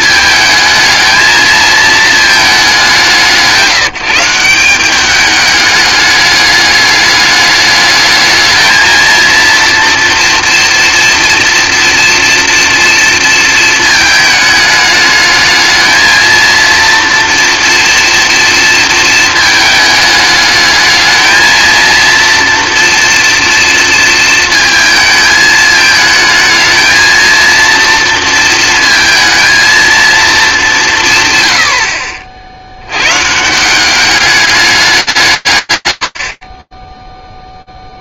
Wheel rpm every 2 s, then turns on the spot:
220, 210, 180, 210, 220, 230, 230, 220, 230, 230, 210, 230, 220, 220, 230, 210, 70, 210, 50.
none